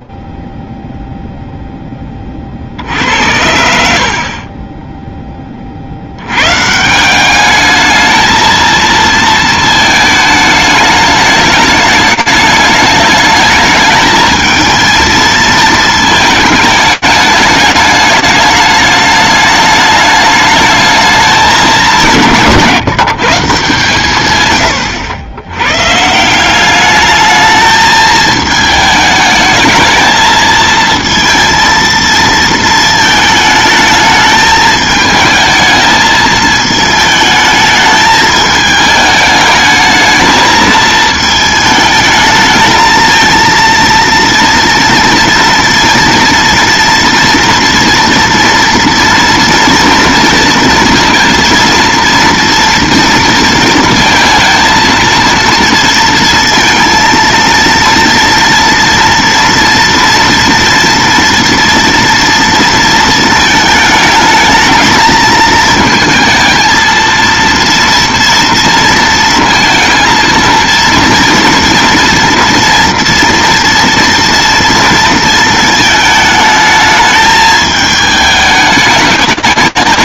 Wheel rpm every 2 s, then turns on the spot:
0, 10, 70, 80, 220, 220, 210, 210, 220, 210, 210, 190, 130, 160, 220, 220, 230, 220, 220, 210, 220, 220, 230, 230, 230, 230, 230, 230, 230, 230, 230, 230, 220, 230, 230, 230, 230, 230, 220, 210.
none